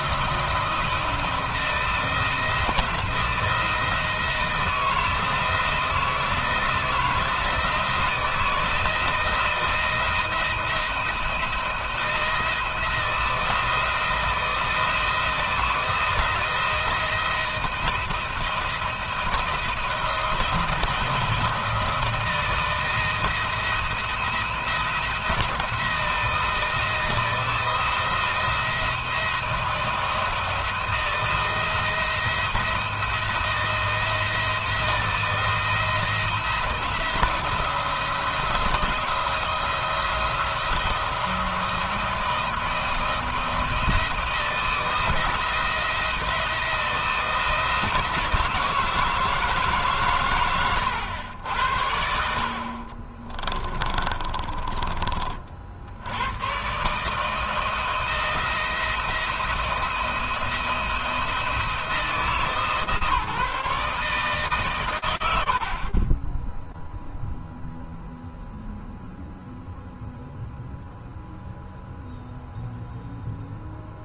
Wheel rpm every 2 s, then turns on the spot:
170, 170, 170, 160, 160, 170, 170, 170, 170, 170, 170, 170, 170, 170, 170, 170, 170, 170, 170, 170, 170, 170, 170, 170, 160, 110, 60, 30, 110, 170, 170, 160, 140, 10, 0, 0, 0.
52-56